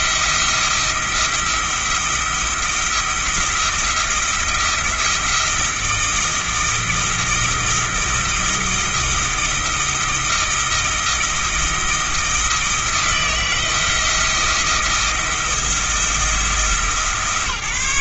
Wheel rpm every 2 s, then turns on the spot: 170, 170, 170, 160, 160, 160, 160, 160, 160.
none